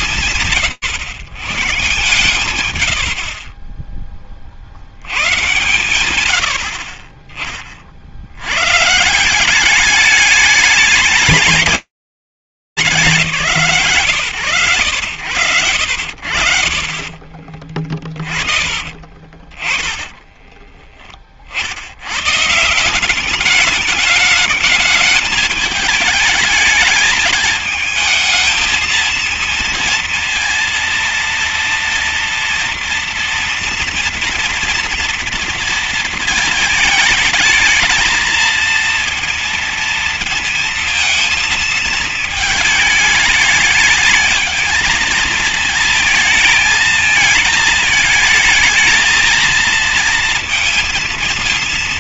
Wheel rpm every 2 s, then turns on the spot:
140, 60, 100, 30, 170, 210, 130, 60, 30, 10, 100, 210, 220, 220, 230, 230, 230, 230, 230, 230, 230, 220, 230, 220, 220, 220.
16-20